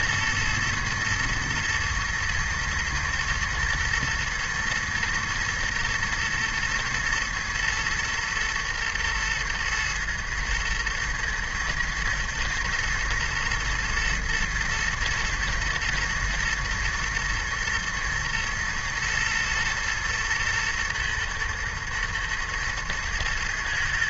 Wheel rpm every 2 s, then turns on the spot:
110, 110, 120, 110, 120, 110, 120, 120, 110, 110, 110, 110.
none